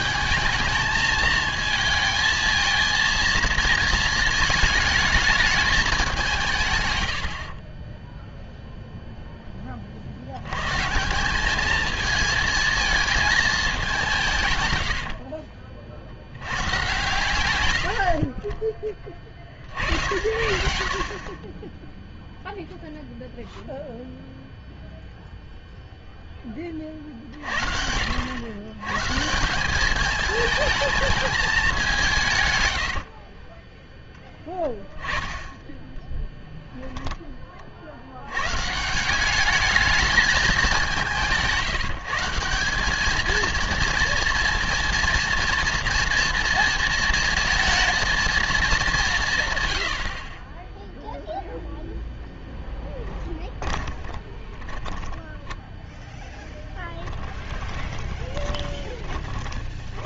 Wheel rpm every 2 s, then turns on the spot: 220, 220, 220, 150, 0, 120, 220, 130, 100, 30, 60, 0, 0, 20, 110, 220, 120, 10, 10, 120, 210, 180, 230, 230, 230, 20, 10, 20, 0, 40.
52-56 58-60